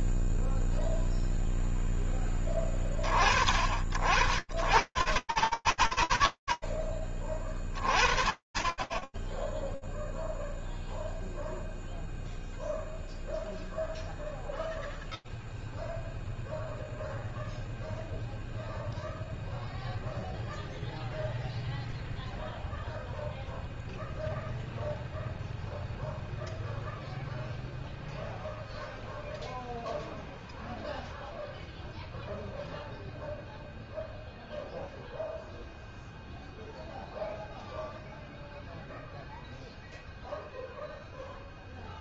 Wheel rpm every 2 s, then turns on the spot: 40, 80, 20, 10, 0, 0, 0, 0, 0, 0, 0, 0, 0, 0, 0, 0, 0, 0, 0, 0, 0.
none